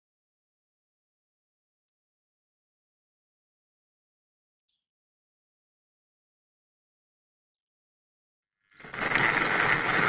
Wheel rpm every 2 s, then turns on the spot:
0, 0, 0, 0, 0.
none